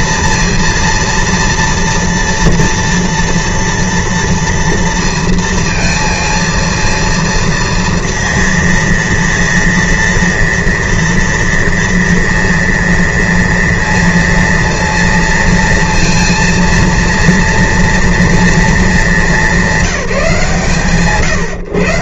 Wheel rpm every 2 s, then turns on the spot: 230, 230, 230, 230, 230, 230, 230, 230, 230, 210, 140.
none